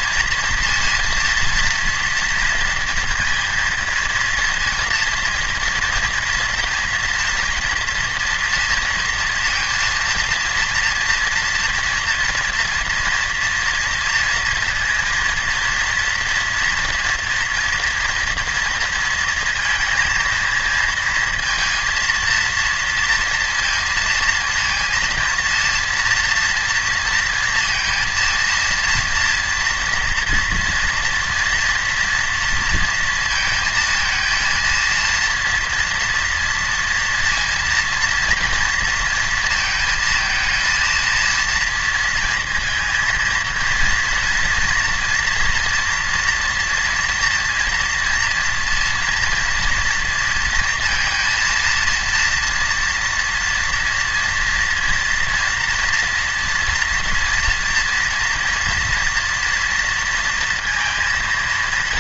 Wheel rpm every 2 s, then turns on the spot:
230, 230, 230, 230, 230, 230, 230, 230, 230, 230, 230, 230, 230, 230, 230, 230, 230, 230, 230, 240, 220, 230, 230, 230, 230, 230, 230, 230, 230, 230, 230.
none